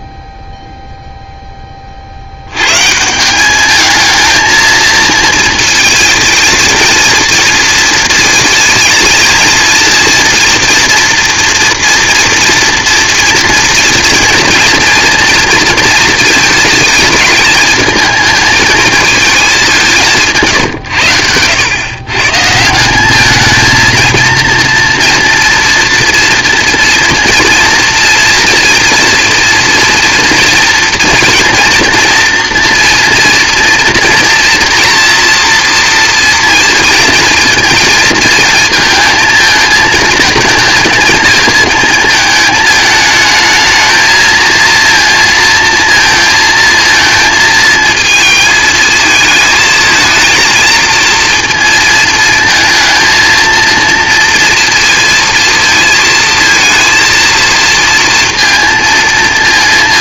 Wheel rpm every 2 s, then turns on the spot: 0, 110, 220, 230, 230, 240, 230, 230, 220, 220, 150, 160, 230, 230, 230, 230, 230, 240, 230, 230, 230, 220, 230, 230, 220, 230, 230, 230, 230, 230.
20-22